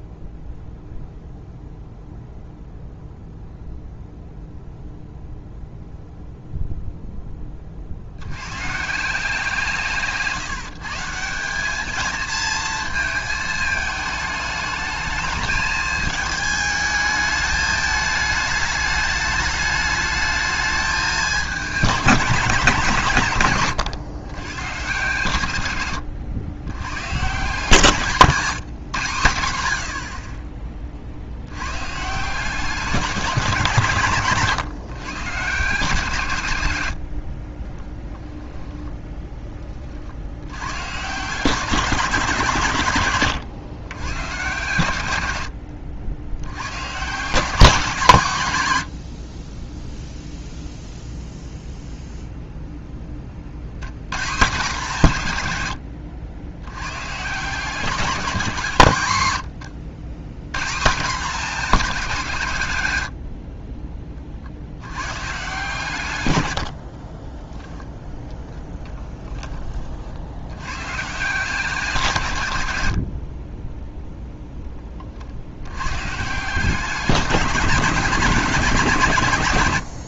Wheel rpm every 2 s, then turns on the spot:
0, 0, 0, 0, 130, 160, 220, 210, 220, 210, 220, 170, 130, 110, 160, 40, 170, 130, 100, 10, 130, 150, 120, 120, 120, 0, 0, 160, 100, 170, 140, 140, 60, 80, 10, 120, 100, 20, 190, 180.
66-68